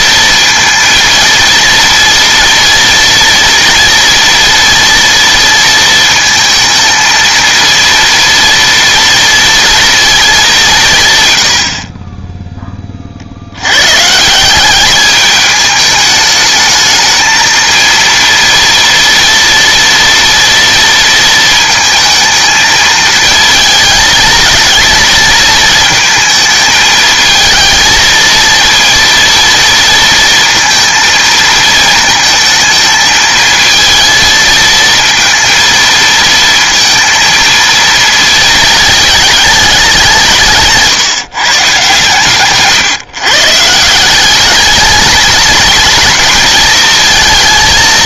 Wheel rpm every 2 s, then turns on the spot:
230, 230, 230, 220, 230, 180, 20, 200, 210, 230, 230, 220, 220, 220, 230, 230, 220, 230, 230, 220, 160, 140, 210, 220.
none